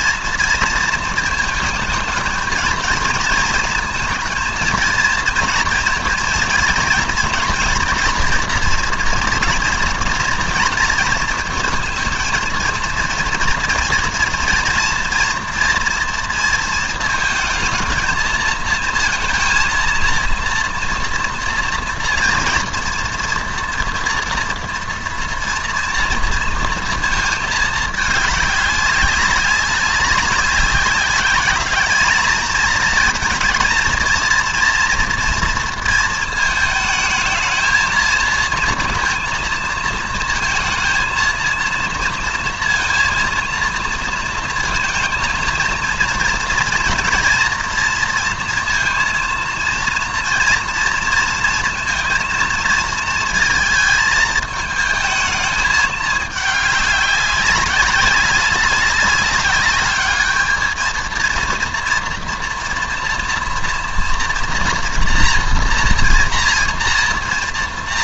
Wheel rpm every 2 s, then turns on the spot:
230, 220, 230, 230, 230, 230, 230, 230, 230, 230, 230, 230, 230, 230, 200, 190, 220, 240, 220, 230, 230, 230, 230, 240, 230, 230, 230, 220, 210, 200, 220, 230, 230, 240.
none